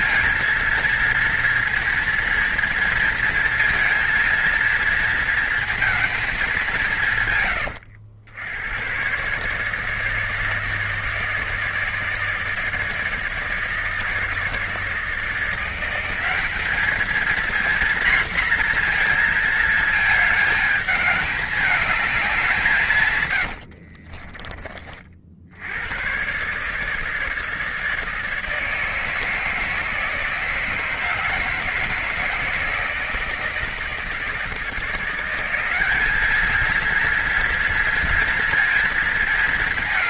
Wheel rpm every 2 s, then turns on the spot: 230, 230, 230, 200, 100, 160, 160, 160, 210, 240, 220, 180, 30, 150, 160, 160, 160, 160, 220, 230.
none